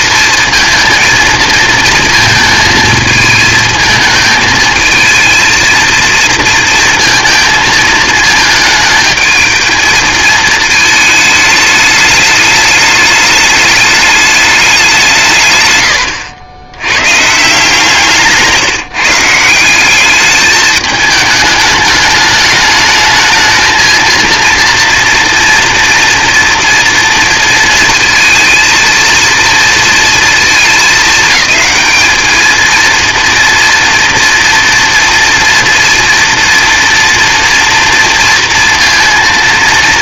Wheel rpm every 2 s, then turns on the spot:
220, 220, 220, 230, 220, 220, 210, 200, 100, 160, 210, 210, 230, 230, 230, 220, 220, 230, 230, 230.
none